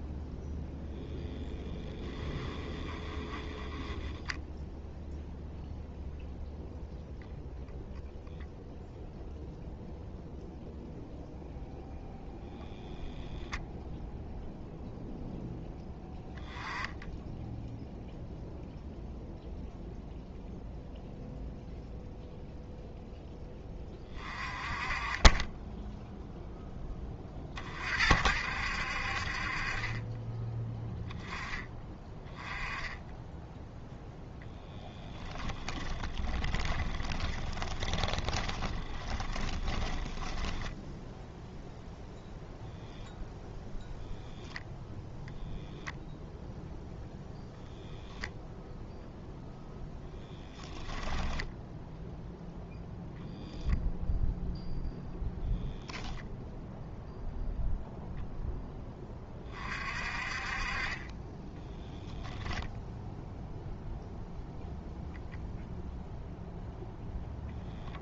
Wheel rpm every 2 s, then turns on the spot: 0, 10, 0, 0, 0, 0, 0, 0, 10, 0, 0, 0, 20, 20, 50, 10, 10, 10, 20, 20, 0, 0, 0, 0, 0, 10, 0, 0, 0, 10, 30, 0, 0, 0.
2-4 36-40